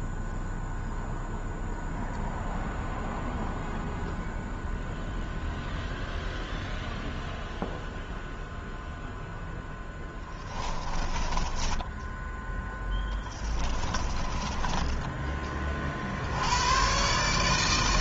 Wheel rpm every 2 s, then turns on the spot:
0, 0, 0, 0, 0, 10, 10, 20, 120.
10-12 14-16